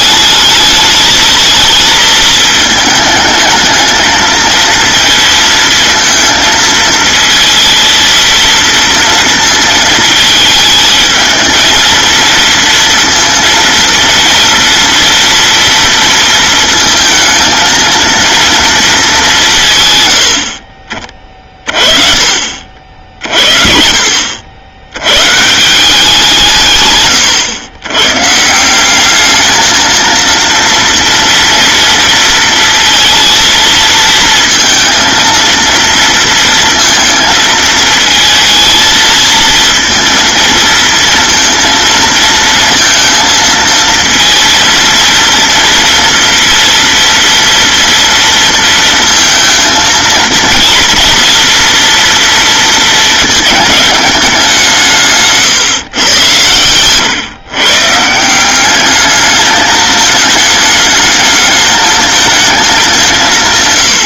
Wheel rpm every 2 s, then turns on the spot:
220, 220, 230, 220, 230, 220, 230, 230, 230, 230, 40, 50, 90, 140, 170, 230, 230, 230, 230, 230, 230, 230, 230, 230, 230, 230, 230, 170, 120, 200, 210, 210.
56-58